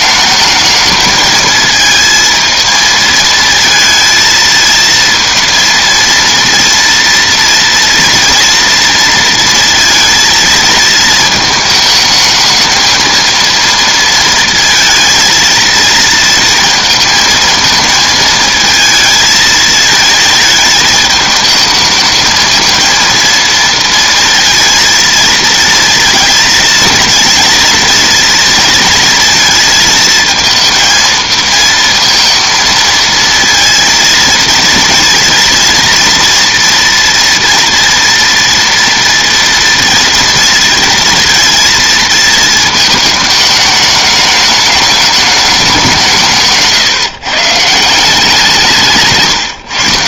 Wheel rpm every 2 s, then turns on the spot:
210, 220, 220, 230, 230, 220, 220, 230, 230, 220, 220, 220, 230, 220, 230, 230, 230, 230, 230, 230, 230, 220, 210, 150, 170.
none